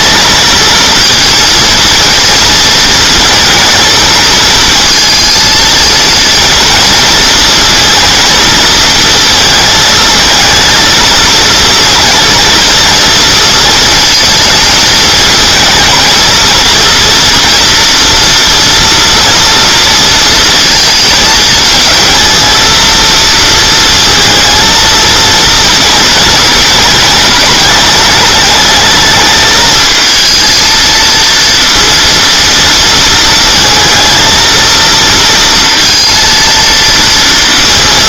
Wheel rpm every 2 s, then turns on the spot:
220, 230, 220, 220, 230, 230, 230, 220, 230, 230, 230, 220, 230, 220, 220, 230, 230, 220, 230.
none